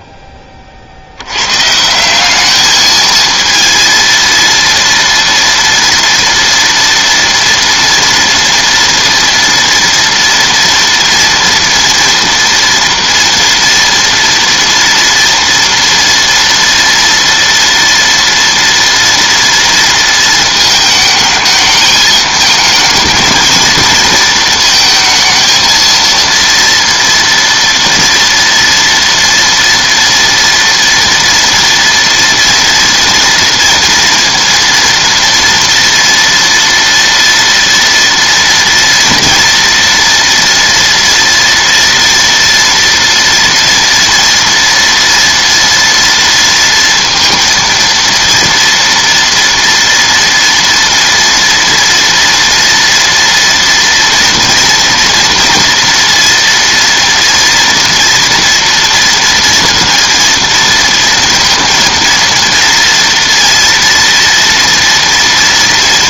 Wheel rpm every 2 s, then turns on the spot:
50, 220, 230, 230, 230, 230, 230, 240, 230, 230, 220, 220, 220, 230, 230, 230, 230, 230, 230, 230, 230, 240, 230, 230, 230, 230, 240, 230, 230, 230, 230, 230, 230.
none